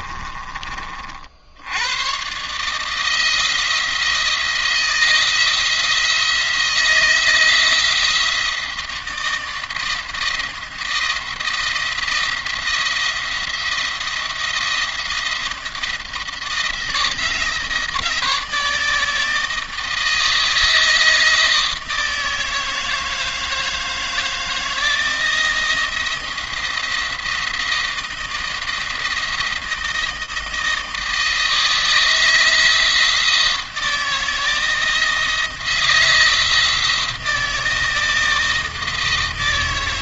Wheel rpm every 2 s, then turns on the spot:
40, 150, 170, 160, 160, 170, 170, 170, 170, 160, 160, 160, 160, 170, 170, 160, 160, 160, 170, 160.
none